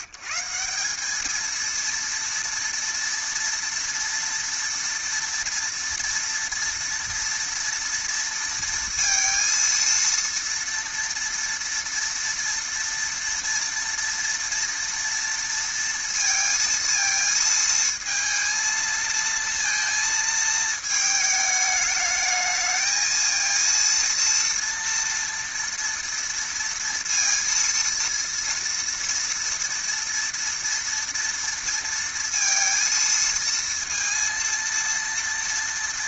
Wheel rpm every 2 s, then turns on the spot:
150, 230, 230, 230, 230, 230, 230, 230, 230, 230, 220, 220, 230, 230, 230, 230, 230, 230.
none